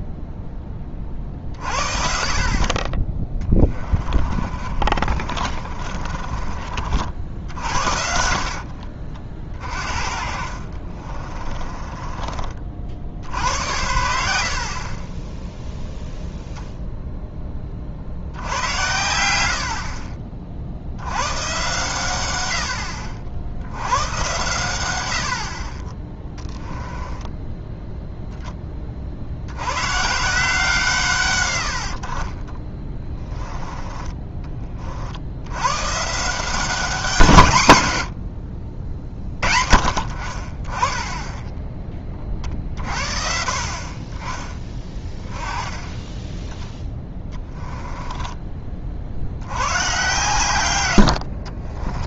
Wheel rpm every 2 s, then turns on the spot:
20, 30, 40, 50, 50, 50, 50, 40, 0, 100, 70, 80, 100, 10, 20, 160, 30, 40, 180, 60, 30, 50, 20, 10, 30, 110.
4-6 8-12 26-28 32-34